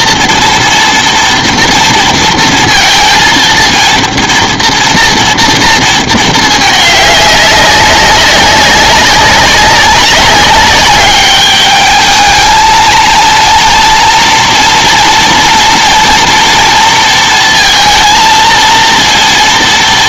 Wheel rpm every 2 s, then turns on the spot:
230, 230, 230, 210, 190, 200, 220, 230, 230, 230.
none